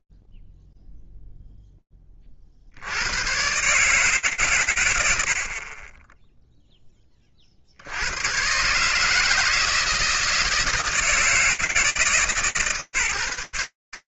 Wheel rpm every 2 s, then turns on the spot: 0, 10, 140, 20, 100, 160, 150.
none